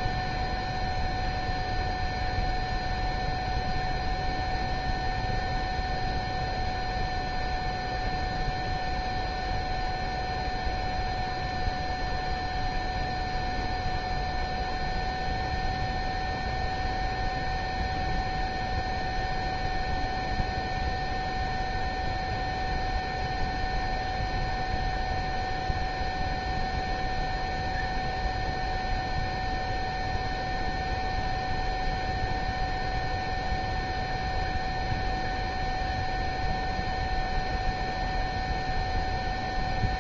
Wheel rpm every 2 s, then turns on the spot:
0, 0, 0, 0, 0, 0, 0, 0, 0, 0, 0, 0, 0, 0, 0, 0, 0, 0, 0, 0.
none